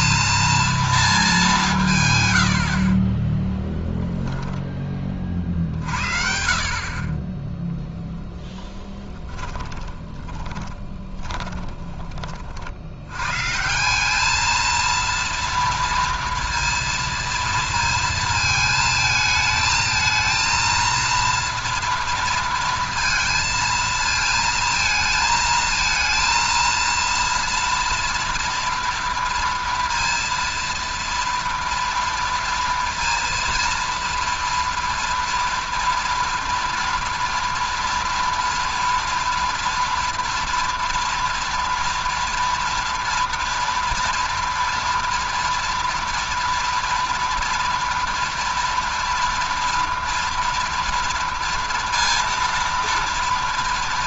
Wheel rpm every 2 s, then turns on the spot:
230, 90, 10, 40, 10, 20, 50, 220, 230, 220, 230, 230, 220, 230, 230, 230, 230, 230, 230, 240, 230, 230, 240, 230, 230, 230, 230.
2-4 8-12